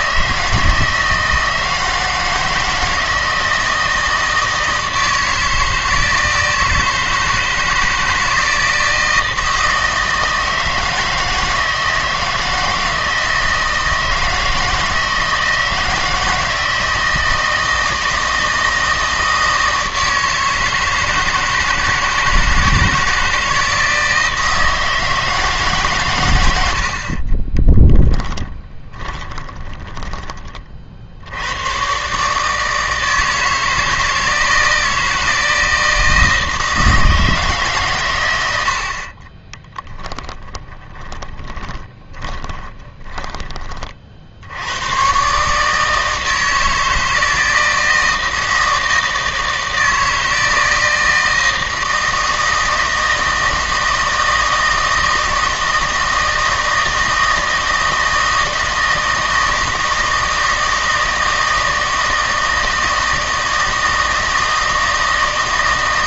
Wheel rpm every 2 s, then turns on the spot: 160, 160, 160, 160, 160, 160, 160, 170, 160, 160, 160, 160, 160, 70, 20, 50, 160, 160, 160, 60, 20, 20, 110, 160, 160, 160, 160, 160, 160, 160, 160, 160, 160.
28-30 40-44